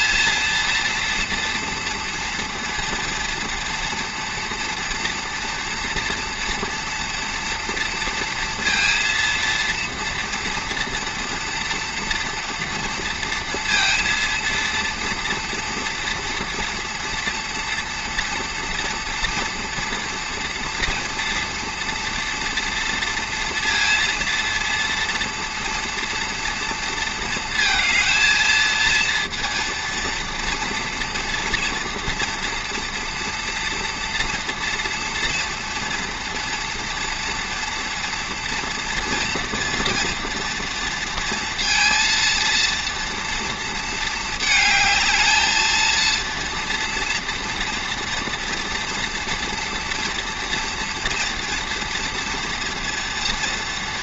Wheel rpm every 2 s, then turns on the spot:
230, 230, 240, 230, 230, 230, 240, 230, 230, 230, 230, 230, 230, 230, 230, 240, 230, 230, 230, 230, 230, 230, 220, 230, 230, 240, 230.
none